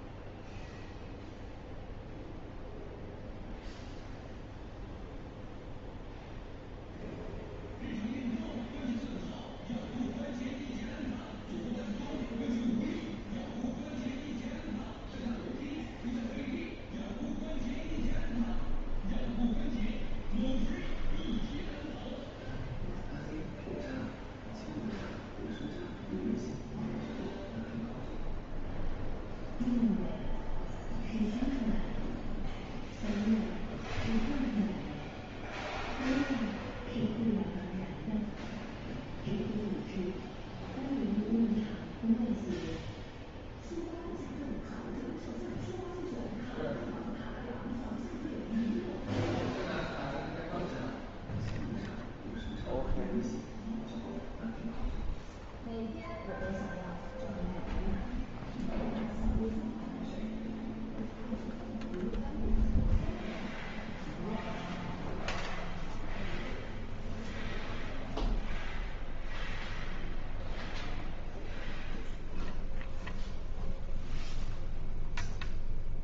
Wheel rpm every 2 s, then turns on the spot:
0, 0, 0, 0, 0, 0, 0, 0, 0, 0, 0, 0, 0, 0, 0, 0, 0, 0, 0, 0, 0, 0, 0, 0, 0, 0, 0, 0, 0, 0, 0, 0, 0, 0, 0, 0, 0, 0.
none